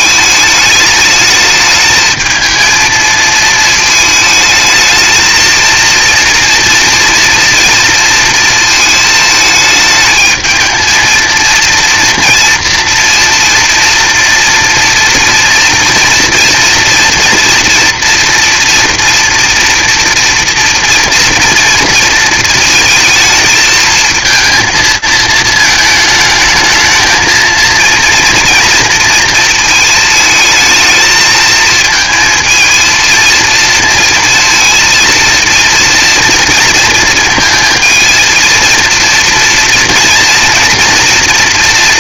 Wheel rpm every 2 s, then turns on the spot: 220, 220, 220, 230, 230, 220, 230, 240, 230, 230, 230, 230, 220, 220, 230, 220, 220, 230, 230, 230, 230.
none